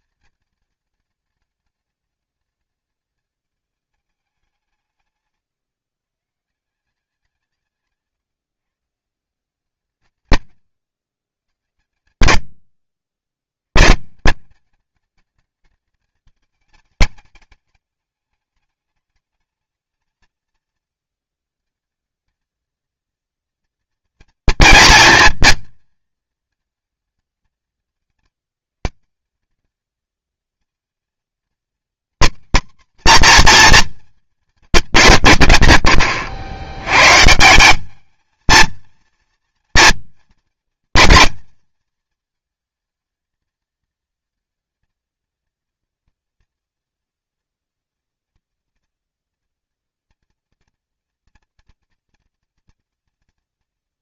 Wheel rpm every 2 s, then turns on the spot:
220, 210, 160, 170, 140, 130, 70, 200, 220, 210, 220, 220, 230, 220, 180, 220, 250, 190, 100, 230, 230, 230, 230, 240, 230, 230, 230.
12-14